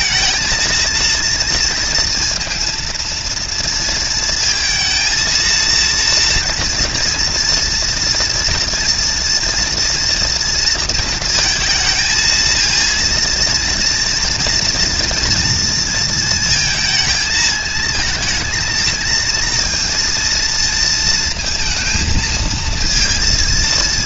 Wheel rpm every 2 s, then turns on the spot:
230, 230, 230, 230, 230, 230, 220, 230, 230, 230, 230, 230.
none